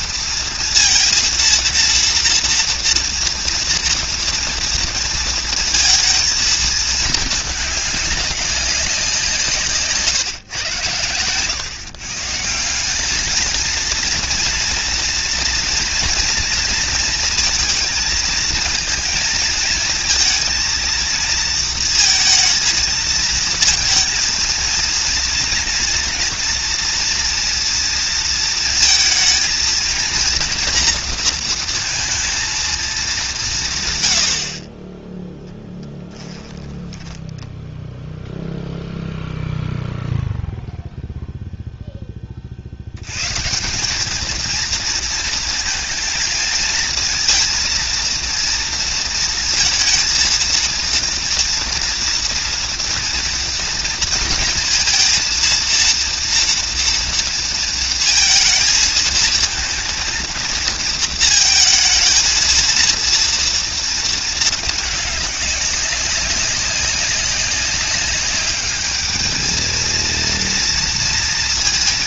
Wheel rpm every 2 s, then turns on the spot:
230, 230, 230, 220, 180, 120, 190, 230, 230, 220, 230, 230, 230, 230, 230, 230, 220, 30, 10, 0, 0, 80, 230, 220, 230, 230, 230, 230, 230, 230, 230, 230, 210, 200, 210, 230.
36-38